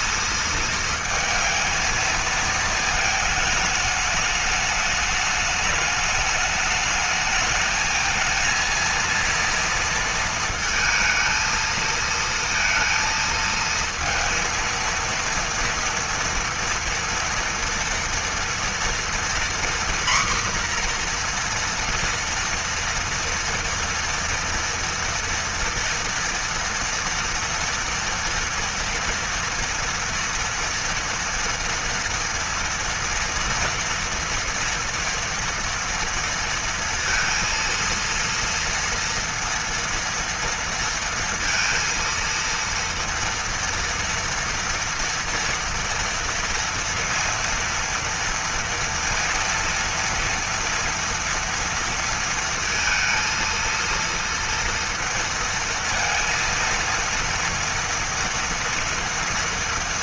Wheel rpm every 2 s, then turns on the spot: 230, 220, 210, 220, 230, 230, 230, 230, 230, 240, 240, 230, 230, 230, 230, 230, 230, 230, 230, 230, 230, 230, 230, 230, 230, 240, 230, 230, 230, 230.
none